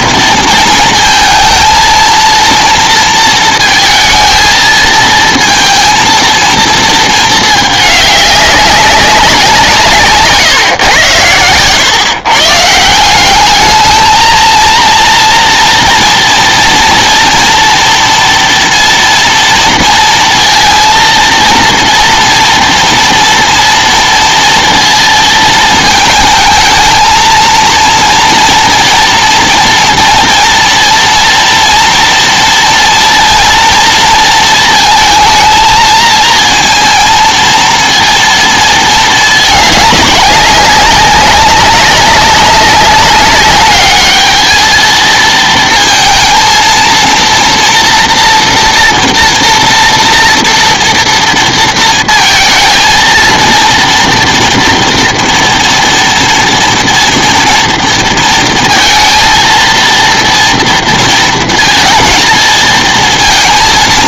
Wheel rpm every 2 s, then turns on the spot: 230, 230, 220, 230, 200, 140, 150, 230, 230, 230, 230, 230, 230, 220, 230, 230, 240, 230, 230, 230, 190, 200, 220, 230, 240, 230, 220, 230, 230, 230, 230, 230.
none